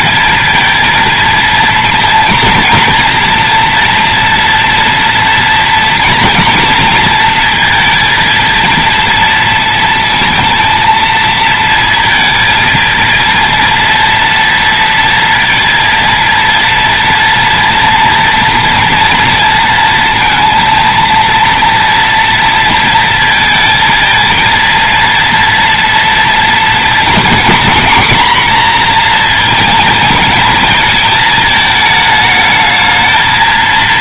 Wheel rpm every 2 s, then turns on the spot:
230, 230, 240, 230, 230, 230, 220, 230, 230, 240, 230, 230, 230, 230, 240, 220, 220.
none